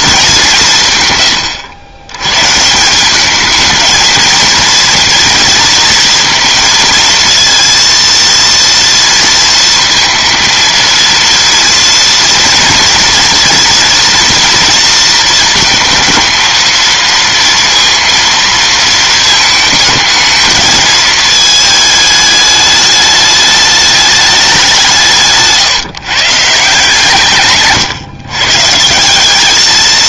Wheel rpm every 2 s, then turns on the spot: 170, 160, 230, 230, 230, 230, 230, 230, 230, 230, 220, 210, 200, 150, 150.
none